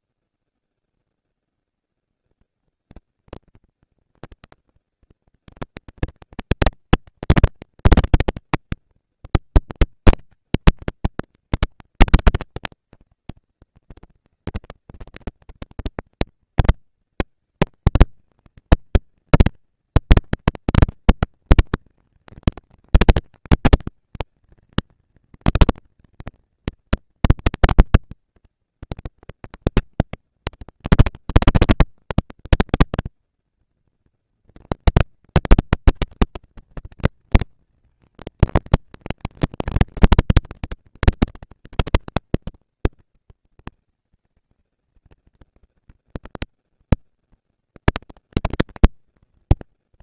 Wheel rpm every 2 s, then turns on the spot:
150, 220, 220, 230, 220, 220, 200, 190, 220, 230, 240, 230, 230, 230, 230, 230, 240, 240, 230, 230, 230, 240, 230, 230, 220.
none